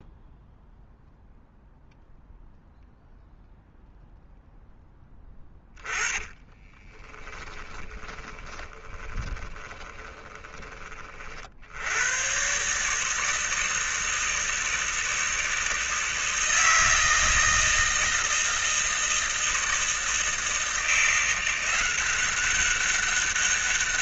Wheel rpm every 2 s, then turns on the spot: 0, 0, 0, 20, 40, 30, 140, 160, 160, 160, 170, 200.
6-10